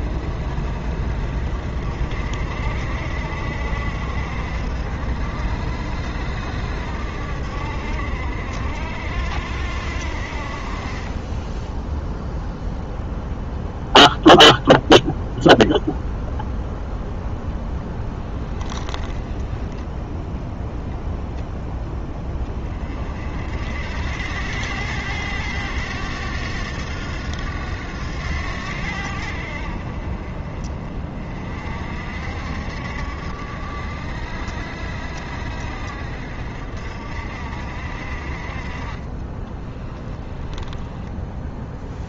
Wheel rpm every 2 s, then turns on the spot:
50, 60, 60, 70, 60, 40, 0, 0, 0, 10, 0, 30, 90, 90, 80, 30, 70, 70, 60, 30, 10.
18-20 38-42